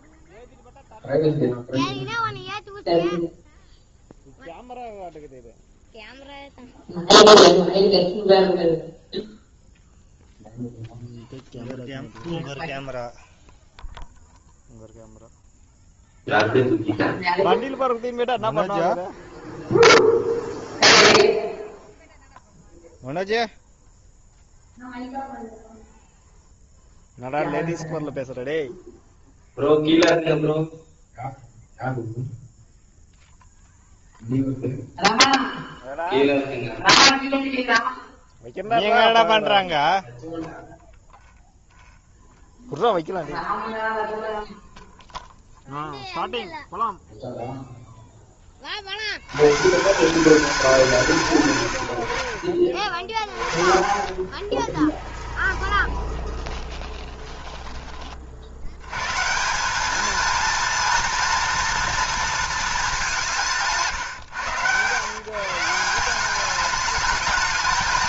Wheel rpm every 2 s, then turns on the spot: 0, 0, 0, 0, 0, 0, 0, 0, 0, 0, 0, 0, 0, 0, 0, 0, 0, 0, 0, 0, 0, 0, 0, 0, 90, 170, 50, 10, 20, 130, 230, 200, 130, 220.
52-58